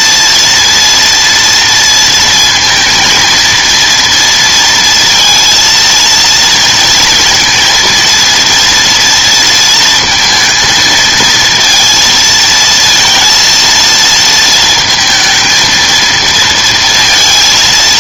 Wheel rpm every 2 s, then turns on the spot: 230, 220, 230, 230, 240, 230, 230, 230, 230.
none